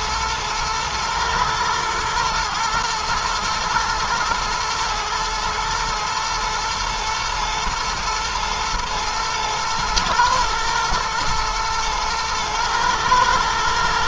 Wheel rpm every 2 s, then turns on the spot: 110, 120, 110, 110, 120, 120, 110.
none